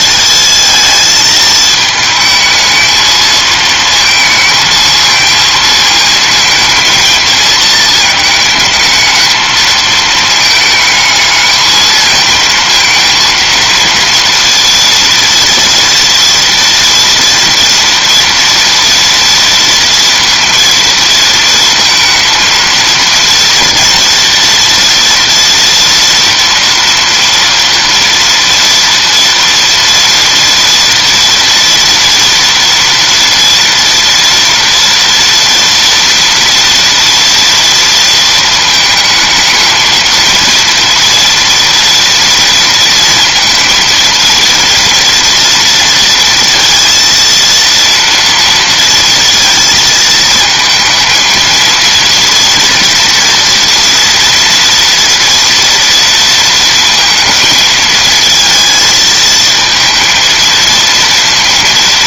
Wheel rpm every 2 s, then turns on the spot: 220, 220, 220, 230, 220, 220, 230, 230, 230, 230, 230, 230, 230, 230, 230, 230, 230, 230, 240, 220, 230, 230, 230, 230, 230, 220, 230, 230, 230, 230, 230.
none